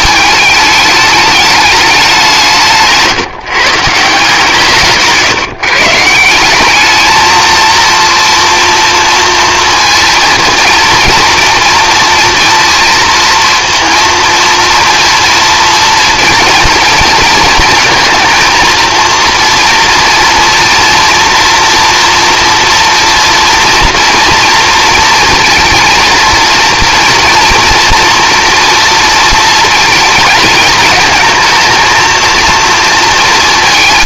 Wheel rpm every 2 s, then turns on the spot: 210, 150, 150, 210, 230, 230, 230, 230, 230, 230, 230, 230, 230, 230, 230, 220, 230.
none